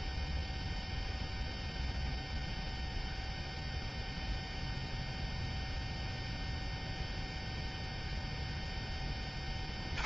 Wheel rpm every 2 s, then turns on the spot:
0, 0, 0, 0, 160.
none